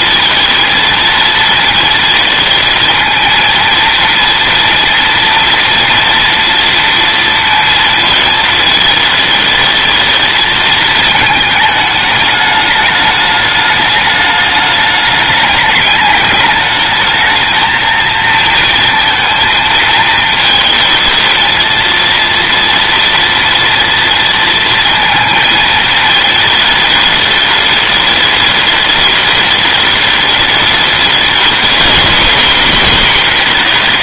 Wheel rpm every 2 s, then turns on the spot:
230, 230, 230, 230, 220, 220, 210, 210, 210, 230, 220, 230, 230, 220, 210, 210, 220.
none